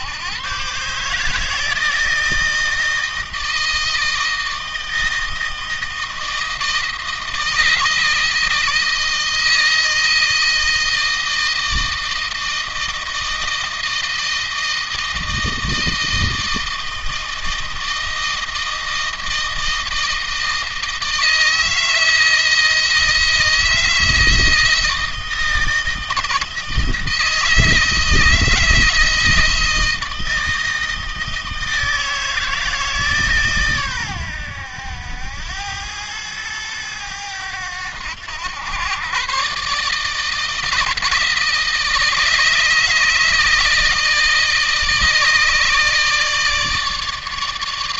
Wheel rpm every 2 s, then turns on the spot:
140, 160, 160, 160, 160, 160, 160, 160, 160, 160, 160, 160, 160, 160, 160, 160, 150, 90, 100, 120, 160, 160, 150, 160.
none